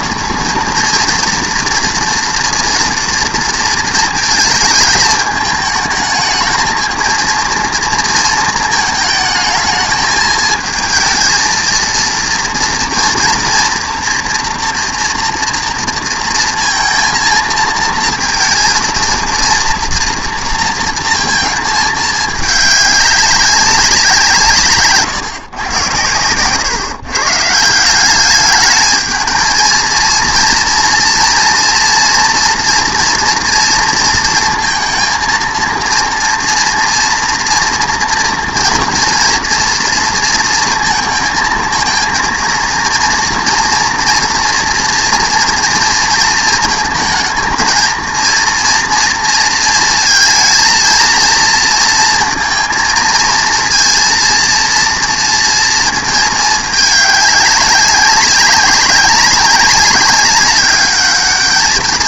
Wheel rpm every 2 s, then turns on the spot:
230, 230, 220, 220, 220, 220, 230, 230, 230, 230, 230, 210, 160, 130, 210, 230, 230, 220, 230, 230, 230, 230, 230, 230, 230, 230, 230, 230, 210, 190, 200.
none